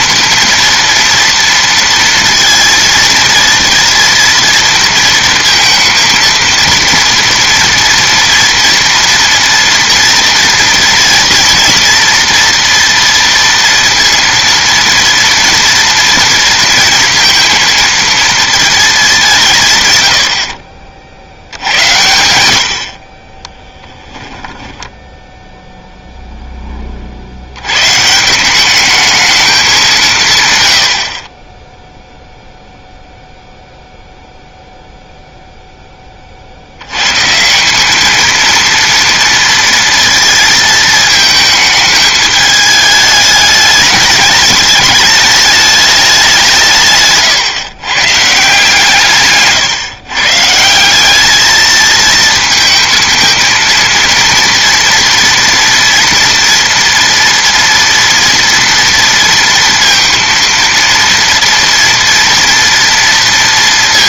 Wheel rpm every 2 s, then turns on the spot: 230, 230, 230, 230, 230, 230, 230, 230, 230, 230, 100, 90, 10, 10, 170, 150, 0, 0, 30, 220, 230, 210, 210, 190, 150, 160, 220, 230, 230, 230, 230, 230.
none